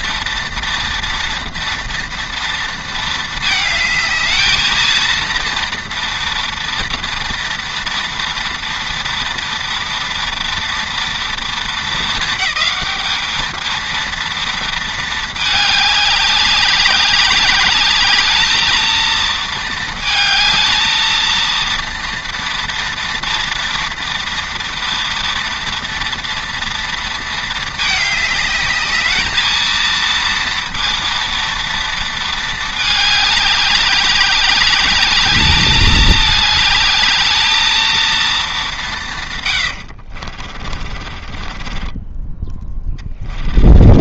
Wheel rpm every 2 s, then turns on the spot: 230, 230, 230, 230, 230, 230, 210, 230, 200, 220, 220, 230, 230, 230, 210, 230, 210, 200, 210, 170, 40, 20.
40-44